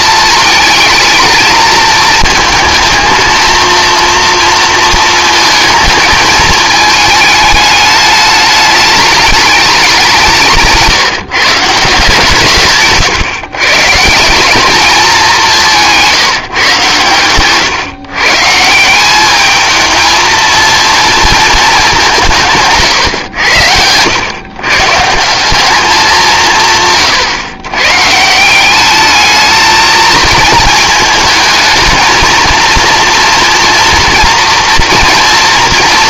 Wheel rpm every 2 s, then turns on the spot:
220, 220, 230, 220, 210, 160, 140, 210, 140, 170, 230, 150, 140, 160, 200, 220, 230, 230.
12-14 22-24